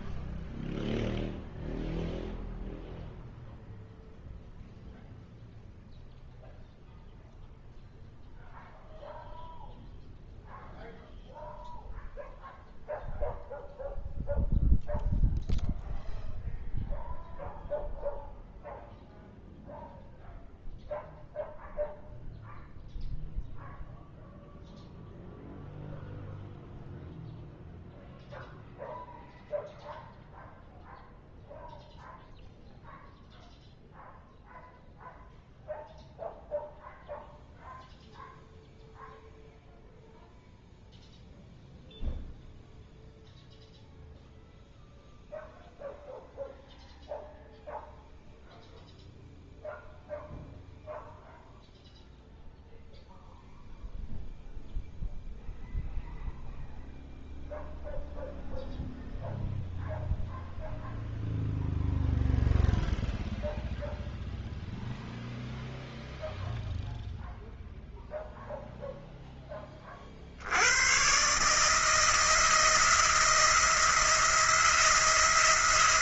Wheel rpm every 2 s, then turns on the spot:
0, 0, 0, 0, 0, 0, 0, 0, 0, 0, 0, 0, 0, 0, 0, 0, 0, 0, 0, 0, 0, 0, 0, 0, 0, 0, 0, 0, 0, 0, 0, 0, 0, 0, 0, 110, 160, 170.
none